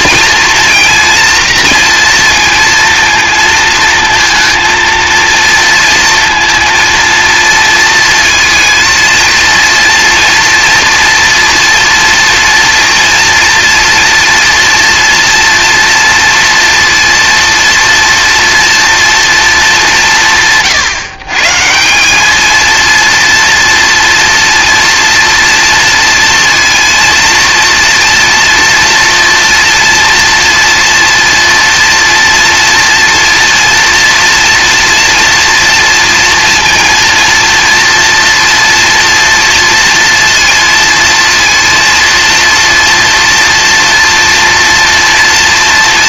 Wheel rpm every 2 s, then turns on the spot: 240, 230, 230, 230, 230, 240, 230, 230, 230, 230, 140, 230, 230, 230, 230, 230, 230, 230, 230, 230, 230, 230, 230.
none